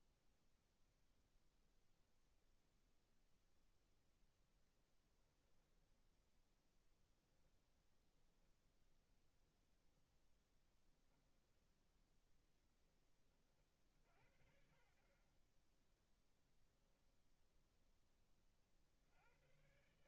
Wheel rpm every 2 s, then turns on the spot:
0, 0, 10, 10, 10, 10, 10, 50, 0, 40.
4-12